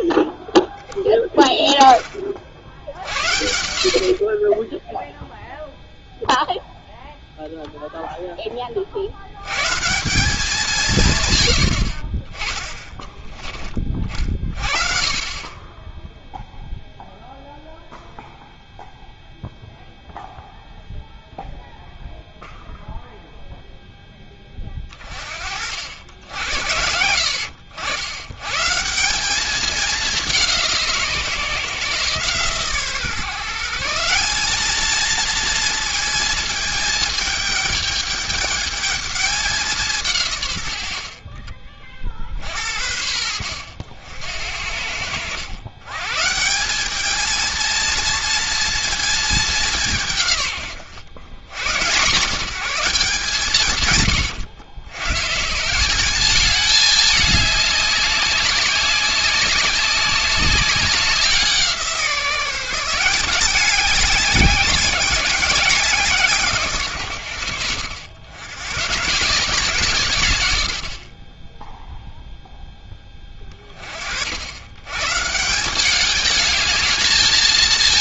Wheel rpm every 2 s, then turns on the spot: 10, 60, 20, 0, 30, 190, 20, 20, 0, 0, 0, 0, 20, 70, 150, 170, 140, 210, 220, 210, 110, 70, 70, 180, 230, 110, 190, 100, 210, 200, 190, 170, 190, 140, 120, 80, 0, 100, 210.
none